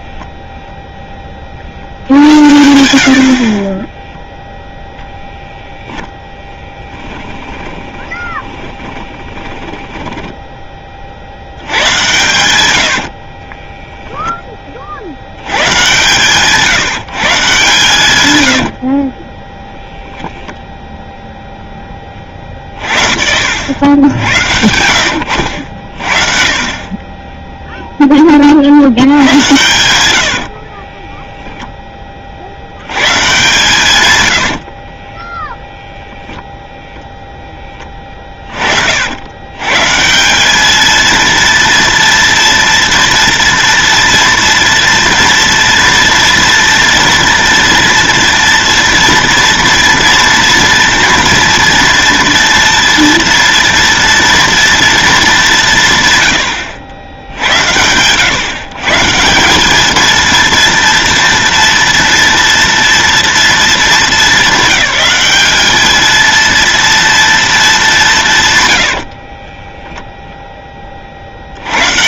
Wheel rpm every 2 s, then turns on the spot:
0, 80, 0, 10, 20, 20, 80, 40, 150, 70, 0, 40, 90, 30, 70, 40, 90, 40, 0, 50, 210, 230, 230, 230, 230, 230, 230, 230, 90, 140, 230, 230, 200, 230, 100, 30.
6-10 12-14 18-20 30-32 34-36 68-70